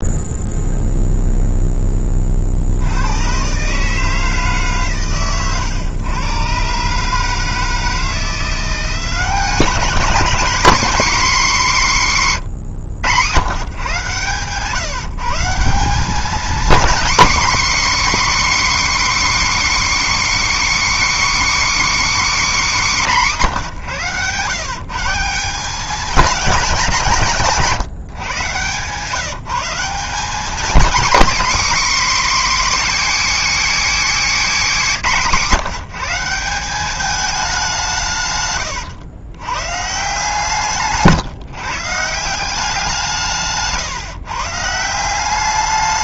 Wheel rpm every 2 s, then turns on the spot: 0, 70, 140, 130, 180, 240, 110, 130, 250, 300, 300, 250, 140, 200, 140, 250, 280, 220, 190, 120, 160, 180, 150.
34-36 38-40